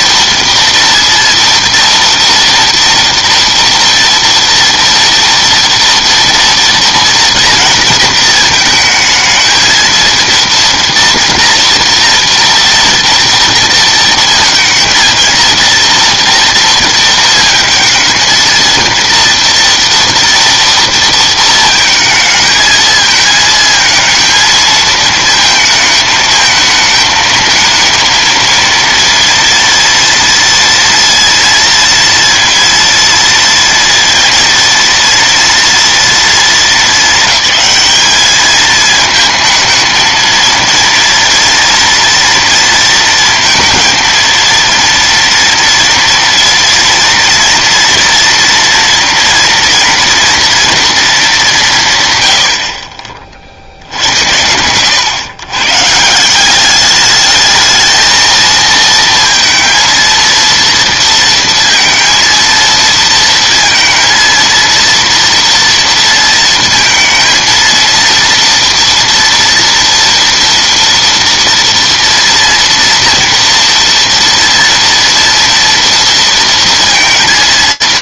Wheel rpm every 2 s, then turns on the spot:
230, 230, 230, 230, 220, 230, 230, 230, 230, 230, 230, 220, 220, 220, 230, 230, 230, 230, 230, 210, 230, 230, 230, 230, 230, 230, 100, 90, 190, 220, 230, 230, 230, 230, 230, 230, 230, 230, 230.
none